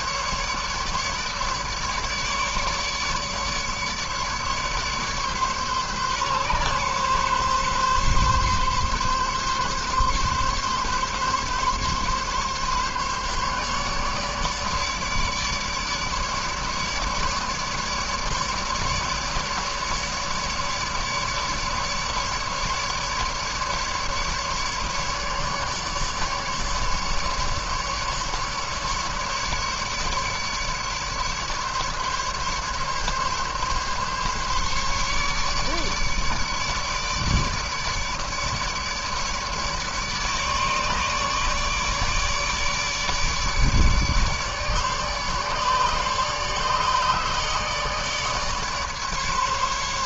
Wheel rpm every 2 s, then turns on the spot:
150, 150, 150, 140, 140, 140, 140, 150, 150, 150, 150, 150, 150, 150, 150, 150, 140, 140, 150, 150, 150, 150, 150, 150, 150.
none